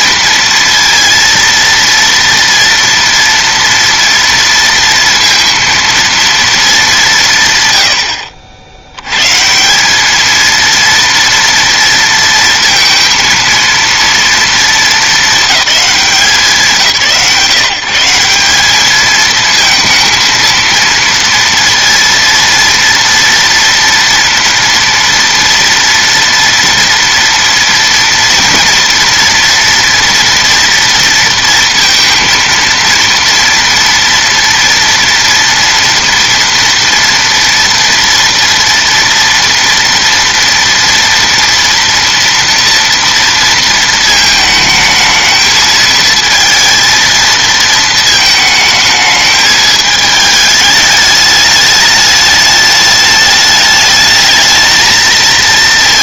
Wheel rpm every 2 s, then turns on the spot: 230, 230, 230, 230, 70, 220, 230, 230, 180, 180, 230, 230, 230, 230, 230, 230, 230, 240, 230, 230, 230, 230, 220, 220, 220, 210, 210, 220.
none